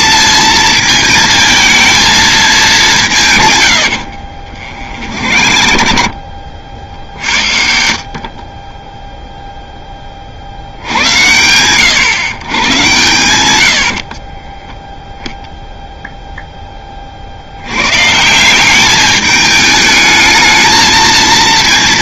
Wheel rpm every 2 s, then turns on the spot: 220, 190, 50, 50, 20, 80, 110, 0, 20, 190, 220.
4-6